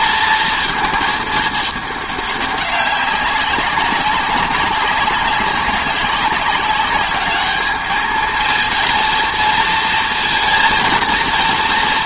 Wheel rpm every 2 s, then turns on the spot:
220, 200, 200, 200, 220, 230.
none